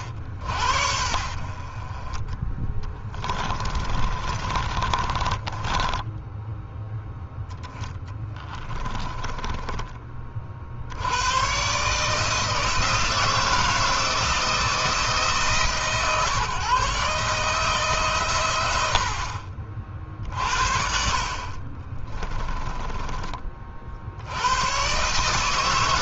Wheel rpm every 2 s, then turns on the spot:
70, 20, 30, 10, 20, 50, 160, 160, 140, 90, 50, 20, 110.
2-6 8-10